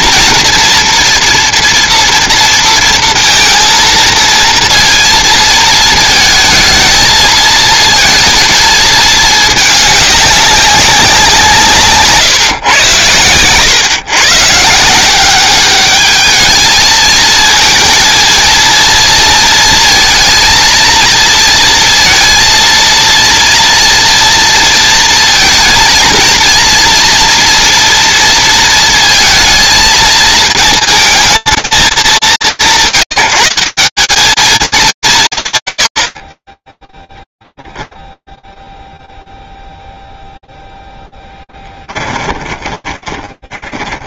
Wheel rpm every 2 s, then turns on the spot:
240, 230, 230, 230, 220, 200, 130, 130, 220, 230, 230, 230, 230, 240, 230, 220, 180, 210, 30, 0, 0, 20.
42-44